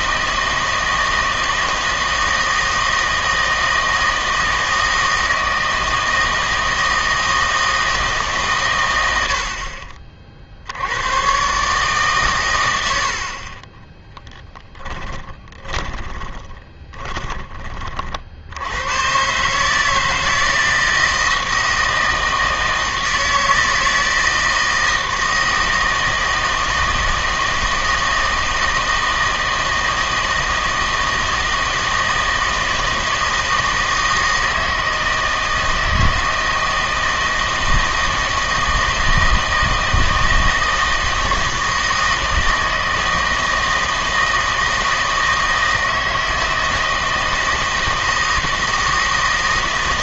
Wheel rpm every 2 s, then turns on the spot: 160, 160, 160, 160, 120, 70, 100, 10, 20, 80, 160, 160, 160, 160, 160, 160, 160, 160, 160, 160, 160, 160, 160, 160, 160.
14-18